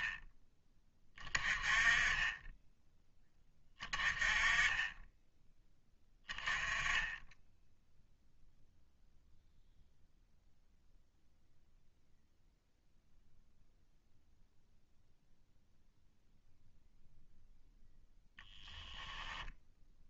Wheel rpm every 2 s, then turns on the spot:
30, 20, 20, 10, 0, 0, 0, 0, 0, 0.
none